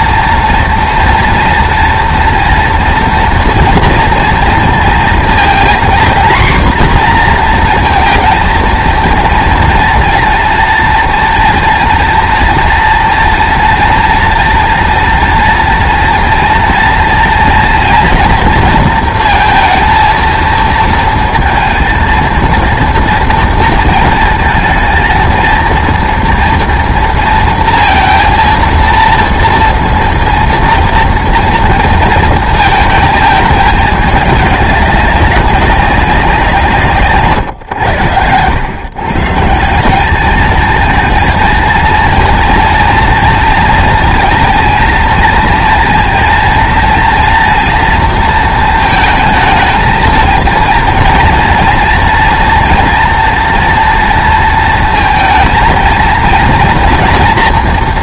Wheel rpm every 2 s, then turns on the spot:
240, 230, 230, 250, 230, 230, 230, 240, 230, 230, 230, 230, 230, 230, 230, 230, 220, 200, 160, 110, 220, 230, 220, 230, 230, 230, 230, 230, 230.
none